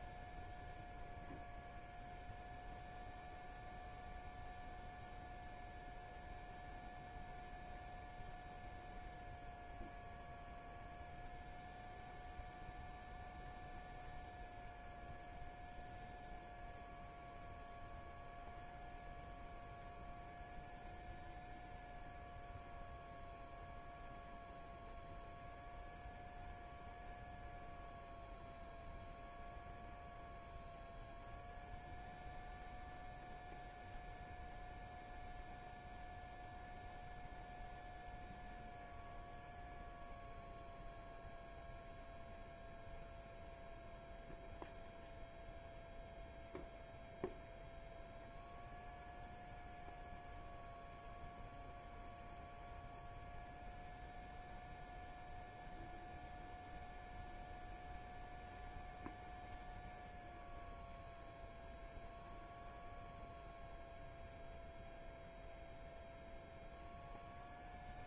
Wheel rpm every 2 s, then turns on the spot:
0, 0, 0, 0, 0, 0, 0, 0, 0, 0, 0, 0, 0, 0, 0, 0, 0, 0, 0, 0, 0, 0, 0, 0, 0, 0, 0, 0, 0, 0, 0, 0, 0, 0.
none